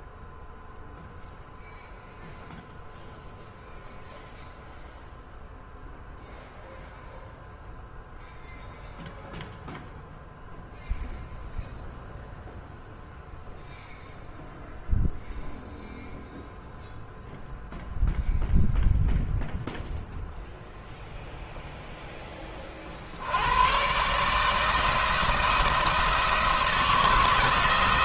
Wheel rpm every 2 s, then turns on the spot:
0, 0, 0, 0, 0, 0, 0, 0, 0, 0, 0, 40, 160, 170.
none